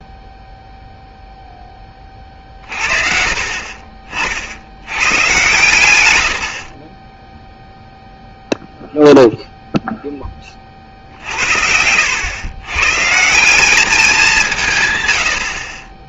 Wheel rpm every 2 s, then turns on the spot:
0, 40, 70, 60, 0, 30, 110, 170.
none